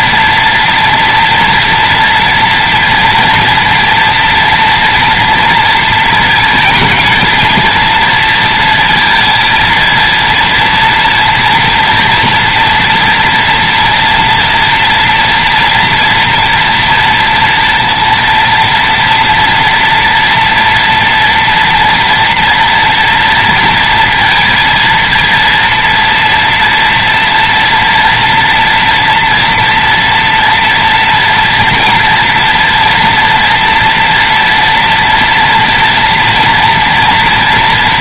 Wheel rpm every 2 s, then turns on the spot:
230, 230, 230, 230, 230, 230, 230, 230, 230, 230, 230, 230, 230, 230, 230, 230, 230, 230, 240.
none